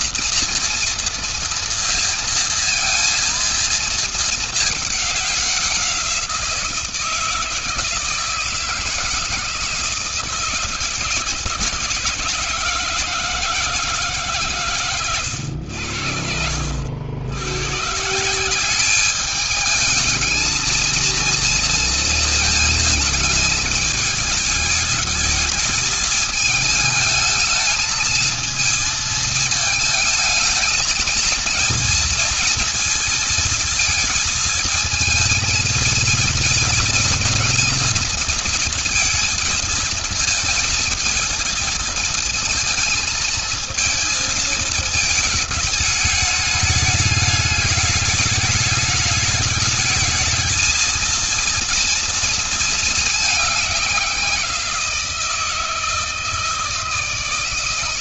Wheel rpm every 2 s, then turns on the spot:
230, 230, 210, 170, 160, 160, 160, 130, 70, 190, 220, 220, 220, 220, 220, 220, 230, 220, 230, 230, 220, 220, 220, 210, 210, 220, 220, 170, 160.
none